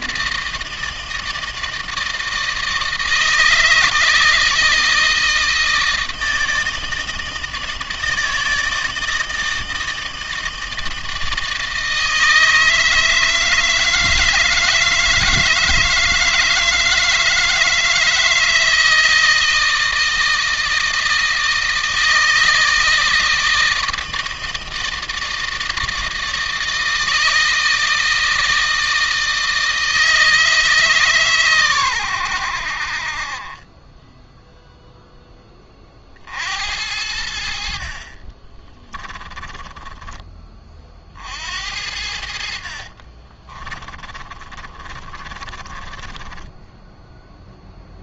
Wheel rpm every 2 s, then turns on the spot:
160, 160, 160, 160, 160, 160, 160, 160, 160, 160, 160, 160, 160, 160, 160, 150, 60, 0, 70, 20, 40, 40, 30, 10.
38-40 42-48